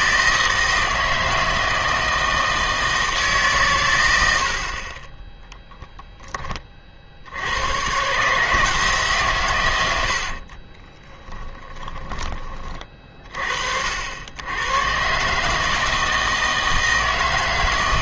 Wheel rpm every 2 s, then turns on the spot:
160, 160, 30, 30, 160, 30, 30, 110, 160.
10-12